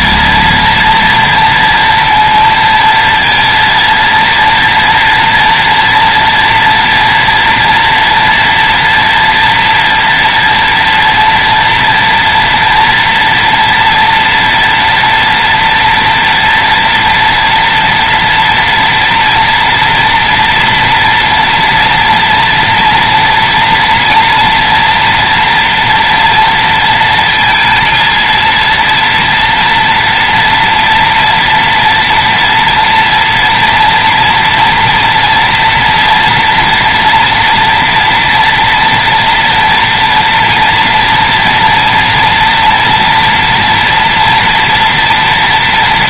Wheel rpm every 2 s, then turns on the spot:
230, 230, 230, 240, 230, 230, 240, 230, 230, 230, 230, 230, 240, 230, 230, 230, 230, 230, 230, 230, 230, 240, 230.
none